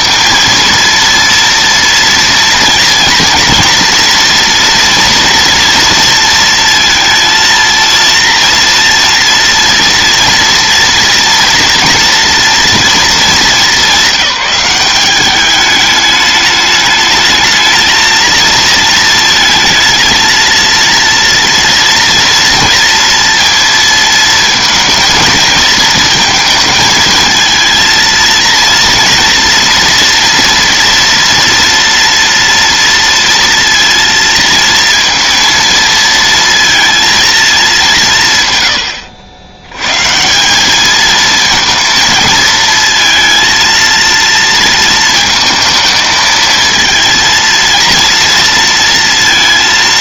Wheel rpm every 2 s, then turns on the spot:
230, 230, 230, 230, 230, 230, 230, 200, 210, 230, 230, 230, 230, 220, 230, 230, 230, 230, 230, 100, 210, 220, 230, 230, 230.
none